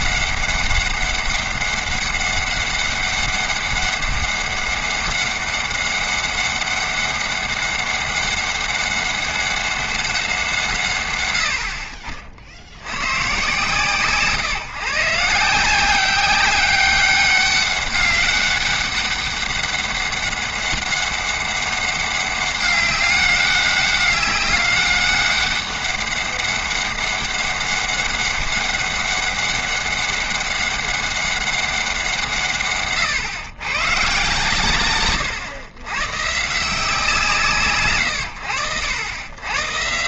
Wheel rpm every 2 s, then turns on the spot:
190, 200, 200, 200, 200, 150, 70, 150, 190, 200, 200, 200, 200, 200, 200, 200, 140, 120, 160, 90.
none